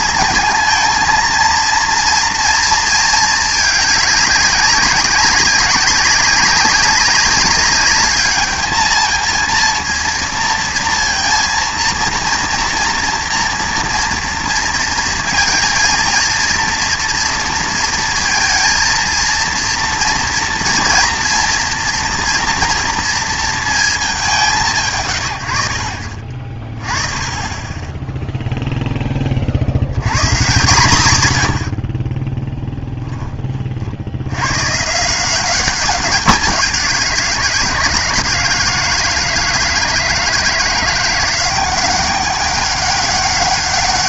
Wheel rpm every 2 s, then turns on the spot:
220, 230, 200, 200, 220, 230, 230, 230, 230, 230, 240, 240, 160, 40, 0, 140, 10, 130, 190, 160, 170, 200.
32-34